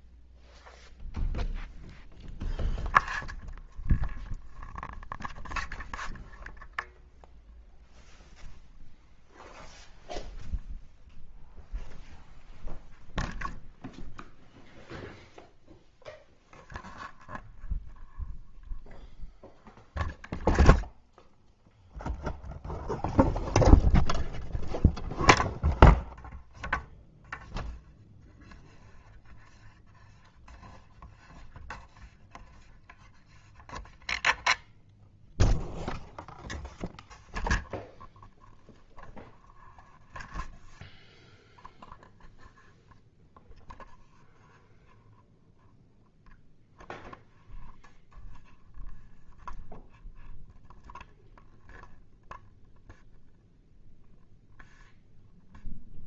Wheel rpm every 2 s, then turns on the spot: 0, 0, 0, 0, 0, 0, 0, 0, 0, 0, 0, 0, 0, 0, 0, 0, 0, 0, 0, 0, 0, 0, 0, 0, 0, 0, 0, 0.
none